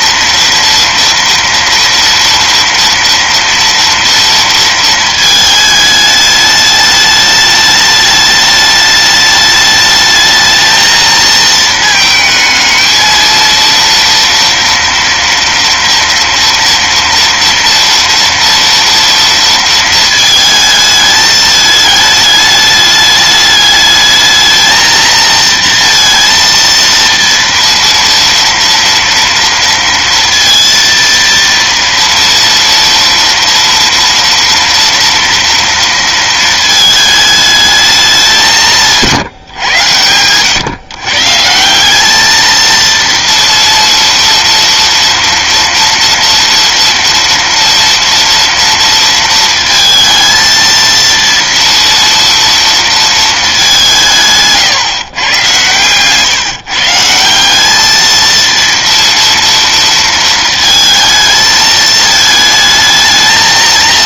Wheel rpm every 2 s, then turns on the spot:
230, 230, 230, 210, 210, 220, 220, 240, 230, 230, 220, 210, 220, 230, 230, 230, 230, 230, 220, 180, 130, 230, 230, 240, 230, 230, 230, 150, 150, 230, 220, 220.
none